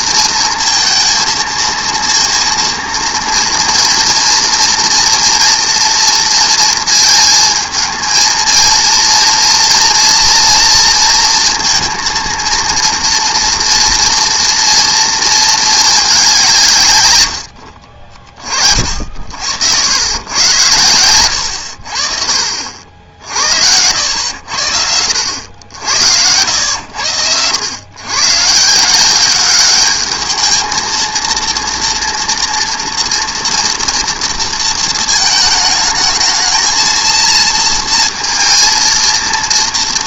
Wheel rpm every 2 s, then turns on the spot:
230, 230, 230, 230, 230, 230, 230, 230, 170, 30, 100, 60, 80, 90, 150, 220, 230, 230, 220, 230.
none